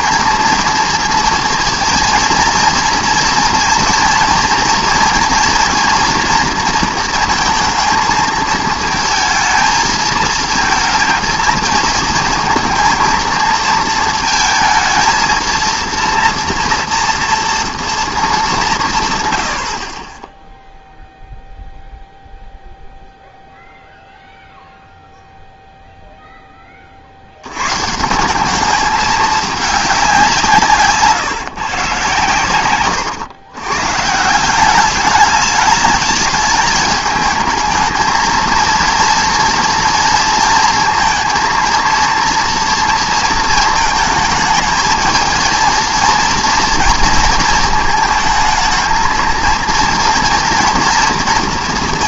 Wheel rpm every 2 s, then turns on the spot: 230, 230, 230, 230, 220, 230, 220, 220, 230, 190, 0, 0, 0, 20, 200, 150, 130, 180, 210, 230, 230, 230, 220, 230, 220, 230.
none